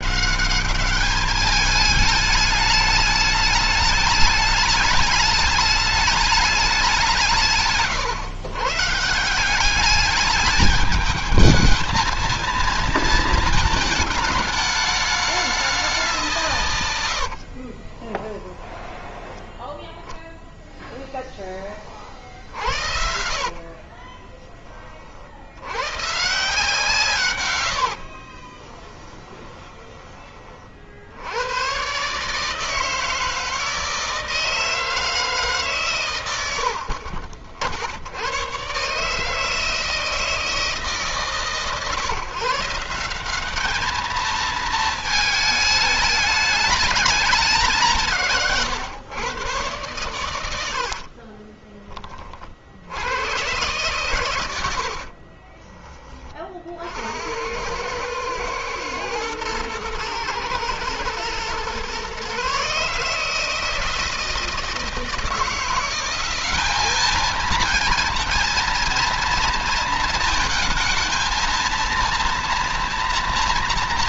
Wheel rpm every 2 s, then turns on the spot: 200, 210, 210, 190, 140, 210, 220, 210, 150, 10, 10, 70, 40, 160, 30, 60, 150, 160, 60, 130, 150, 160, 220, 210, 130, 80, 60, 90, 60, 110, 110, 140, 160, 200, 230, 220, 230.
20-24 28-30 50-52 54-56